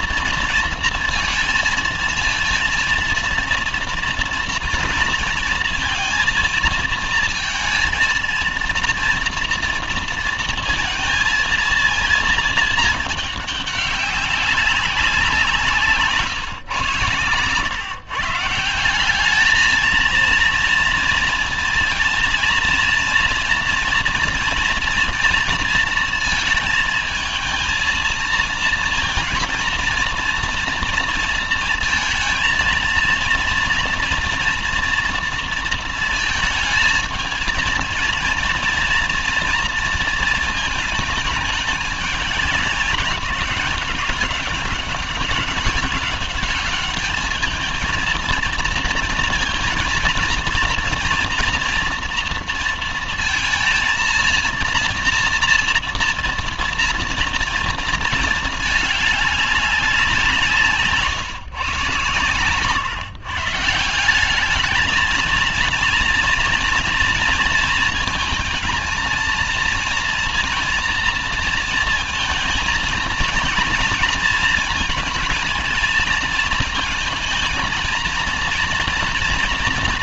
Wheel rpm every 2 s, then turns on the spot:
230, 230, 240, 230, 230, 230, 220, 200, 130, 150, 230, 230, 230, 230, 230, 230, 230, 230, 220, 240, 220, 200, 200, 200, 230, 230, 230, 230, 230, 220, 170, 130, 200, 230, 220, 230, 230, 230, 220, 230.
none